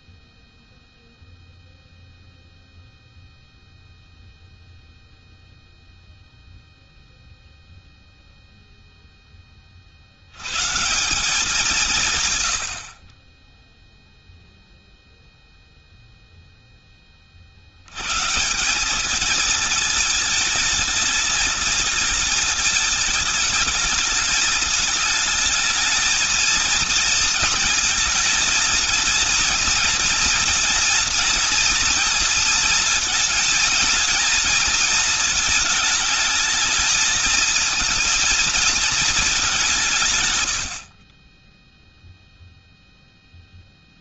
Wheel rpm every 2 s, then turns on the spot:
0, 0, 0, 0, 10, 180, 30, 0, 40, 210, 220, 210, 220, 230, 230, 230, 220, 220, 220, 210, 30, 0.
none